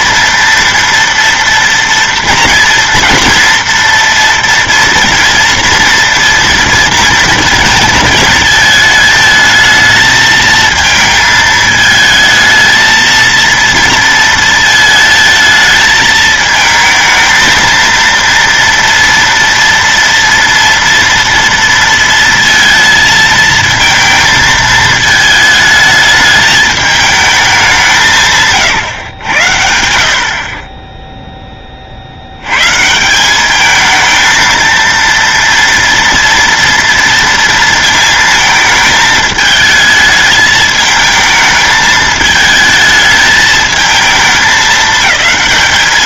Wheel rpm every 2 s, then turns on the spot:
230, 240, 240, 230, 220, 220, 220, 220, 220, 230, 230, 230, 220, 210, 130, 20, 130, 230, 230, 220, 220, 220, 210.
none